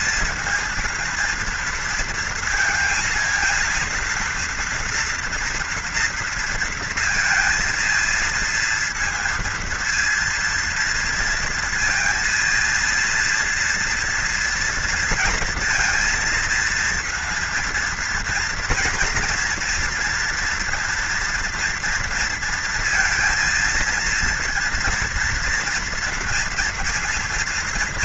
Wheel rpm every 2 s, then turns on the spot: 230, 230, 230, 230, 230, 230, 230, 240, 230, 230, 230, 230, 230, 230.
none